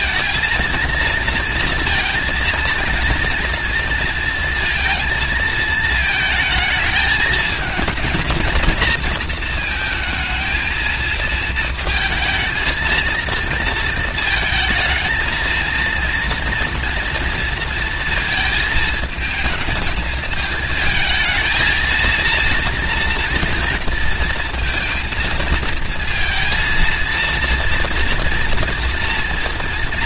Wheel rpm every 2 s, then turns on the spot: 230, 230, 230, 220, 230, 230, 230, 220, 230, 220, 220, 230, 230, 230, 240.
none